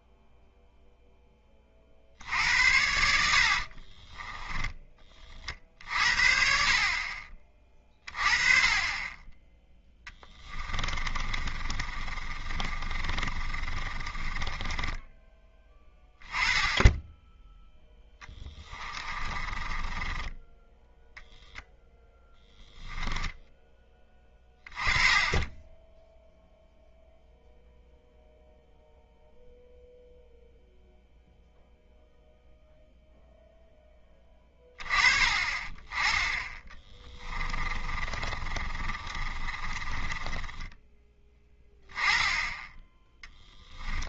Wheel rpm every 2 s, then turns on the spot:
0, 80, 10, 50, 30, 30, 30, 10, 20, 20, 0, 10, 20, 0, 0, 0, 0, 20, 30, 30, 10, 10.
10-16 18-20 36-44